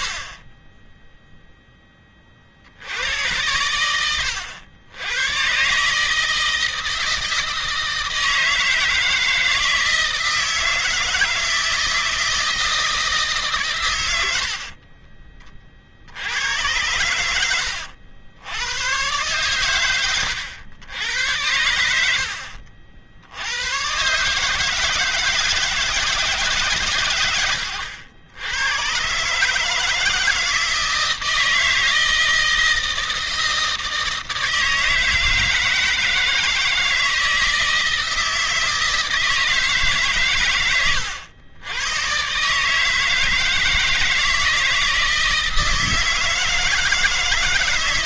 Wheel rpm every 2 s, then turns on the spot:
10, 80, 100, 160, 160, 160, 160, 50, 90, 110, 100, 60, 160, 130, 120, 160, 160, 160, 160, 160, 100, 150, 160, 160.
none